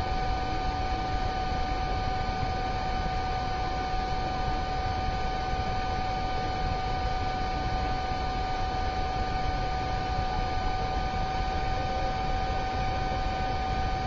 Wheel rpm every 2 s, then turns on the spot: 0, 0, 0, 0, 0, 0, 0.
none